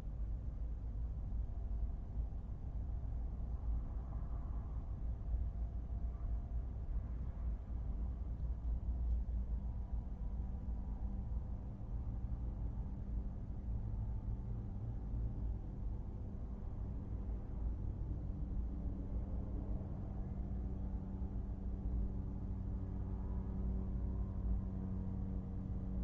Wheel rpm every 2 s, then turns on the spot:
0, 0, 0, 0, 0, 0, 0, 0, 0, 0, 0, 0, 0.
none